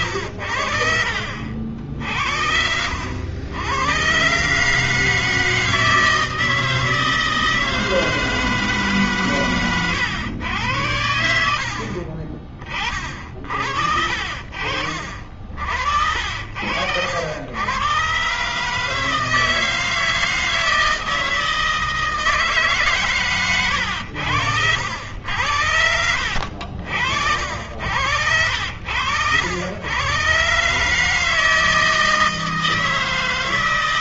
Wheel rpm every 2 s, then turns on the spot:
80, 70, 130, 160, 160, 110, 40, 60, 70, 140, 160, 160, 90, 100, 80, 120, 160.
14-16